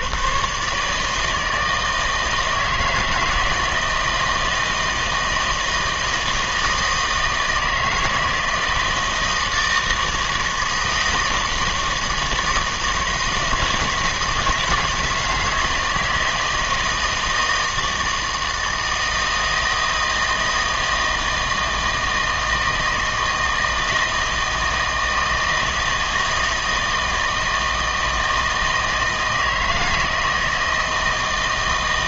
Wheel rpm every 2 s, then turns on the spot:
150, 160, 160, 160, 160, 160, 160, 160, 160, 160, 160, 160, 160, 160, 160, 160.
none